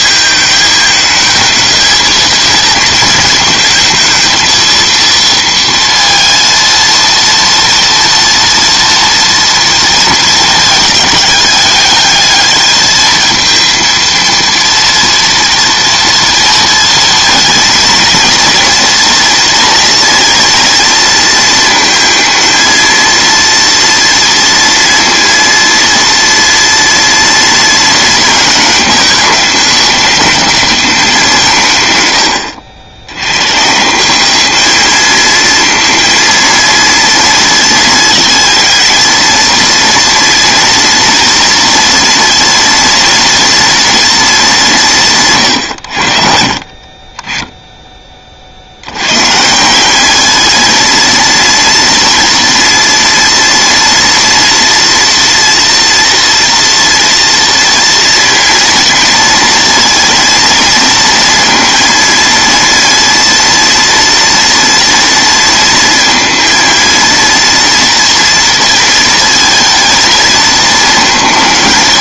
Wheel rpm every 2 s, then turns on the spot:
220, 220, 220, 230, 230, 220, 220, 230, 230, 230, 230, 230, 230, 230, 220, 210, 80, 210, 230, 220, 230, 230, 190, 50, 70, 220, 230, 240, 230, 230, 230, 230, 230, 230, 230, 220.
46-48